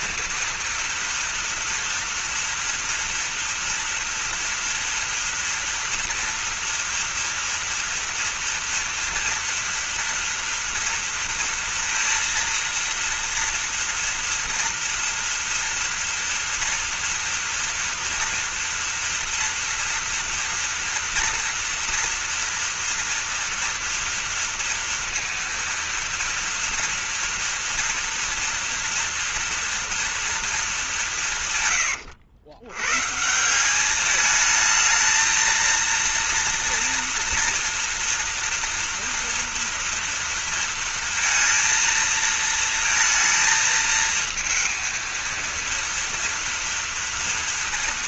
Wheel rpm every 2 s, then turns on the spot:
240, 230, 230, 230, 230, 230, 230, 230, 230, 230, 230, 230, 230, 230, 230, 200, 120, 220, 230, 230, 230, 230, 230, 240.
none